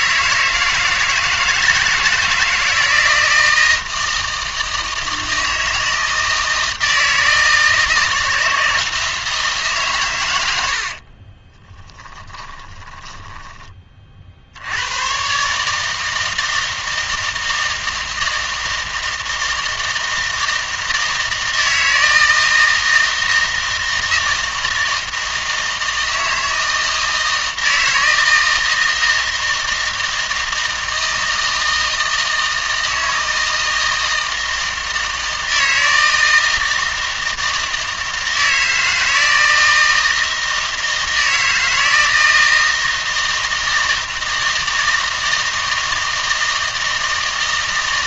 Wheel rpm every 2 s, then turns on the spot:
160, 160, 160, 160, 160, 70, 20, 80, 160, 160, 160, 160, 160, 160, 160, 160, 160, 160, 160, 160, 160, 160, 160, 160.
10-14